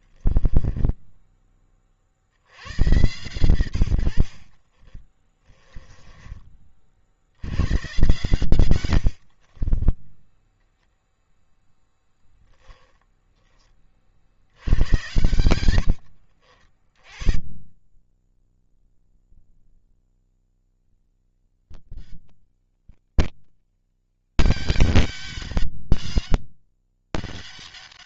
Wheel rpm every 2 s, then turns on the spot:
10, 100, 40, 40, 110, 0, 10, 80, 50, 20, 90, 200, 200, 190.
0-2 4-6 8-10 12-14 18-20